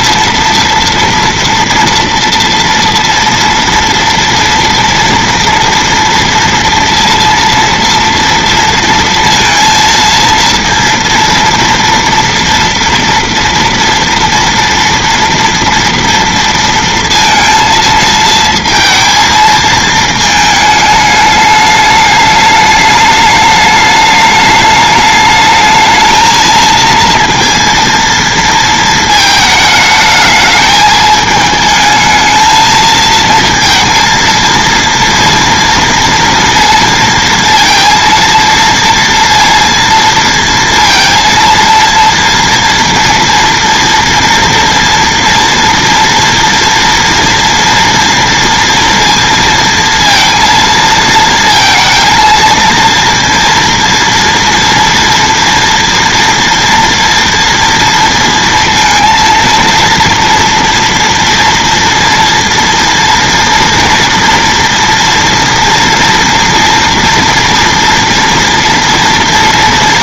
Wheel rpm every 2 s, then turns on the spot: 230, 230, 230, 230, 230, 230, 240, 230, 230, 220, 220, 210, 210, 220, 230, 210, 220, 230, 230, 230, 230, 230, 230, 230, 230, 230, 230, 230, 230, 230, 230, 230, 230, 230, 230.
none